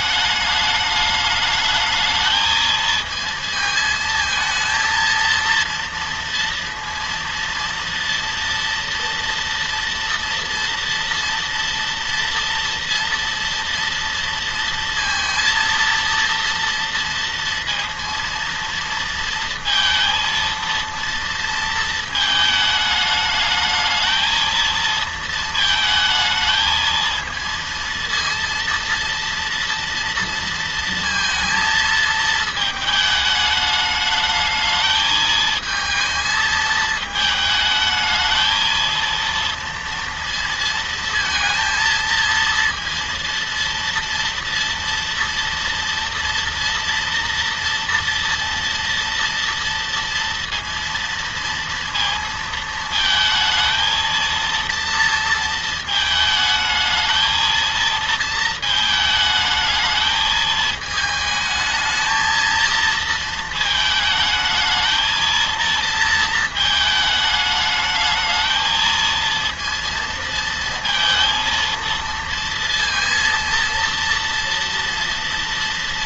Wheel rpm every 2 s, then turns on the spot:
210, 220, 220, 230, 230, 230, 230, 230, 230, 230, 230, 220, 220, 220, 230, 230, 220, 220, 220, 220, 230, 230, 230, 230, 230, 230, 230, 230, 220, 230, 220, 220, 220, 220, 220, 230, 230, 230.
none